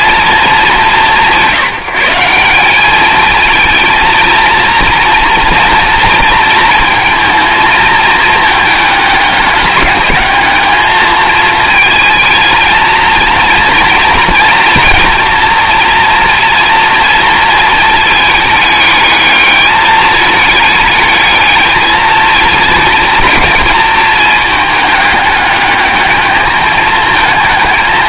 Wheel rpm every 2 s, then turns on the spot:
210, 190, 230, 230, 220, 210, 220, 230, 240, 220, 210, 220, 210, 220.
none